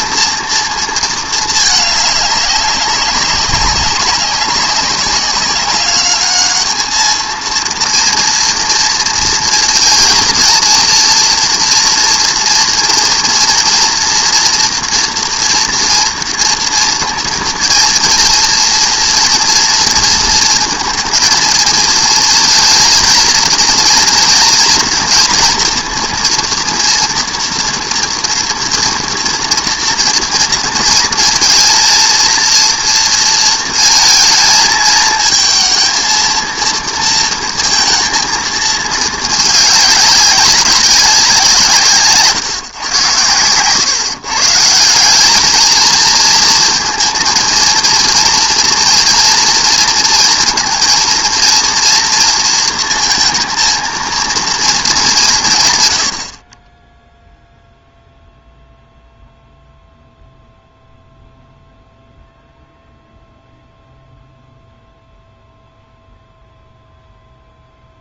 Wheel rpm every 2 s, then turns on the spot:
230, 200, 200, 210, 230, 230, 230, 240, 230, 230, 230, 230, 230, 230, 230, 230, 230, 220, 230, 220, 190, 130, 160, 230, 230, 230, 230, 220, 20, 0, 0, 0, 0, 0.
none